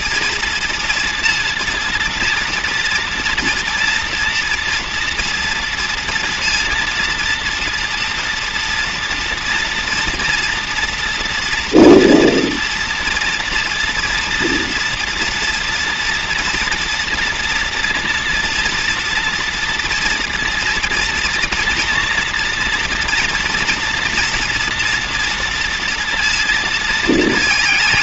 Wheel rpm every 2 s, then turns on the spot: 230, 230, 230, 230, 230, 240, 230, 230, 230, 230, 240, 230, 230, 230.
none